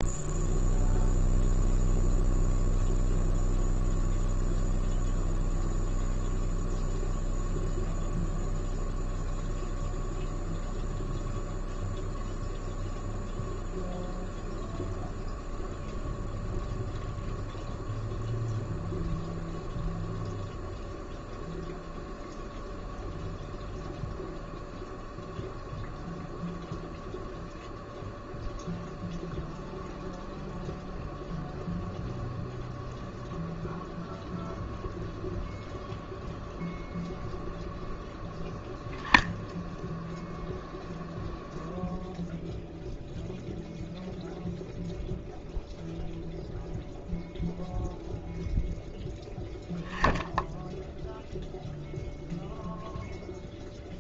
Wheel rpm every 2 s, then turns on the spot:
0, 0, 0, 0, 0, 0, 0, 0, 0, 0, 0, 0, 0, 0, 0, 0, 0, 0, 0, 10, 0, 0, 0, 0, 0, 0, 0.
none